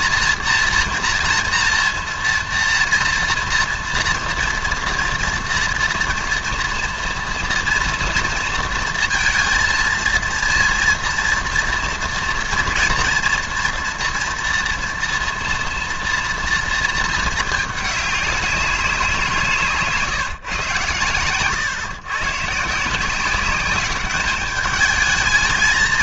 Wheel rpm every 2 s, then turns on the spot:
230, 230, 230, 230, 230, 230, 230, 240, 230, 200, 130, 150, 210.
none